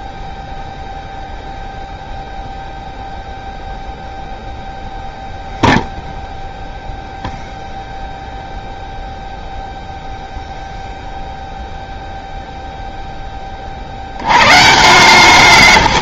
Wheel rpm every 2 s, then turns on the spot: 0, 0, 0, 0, 0, 0, 0, 120.
none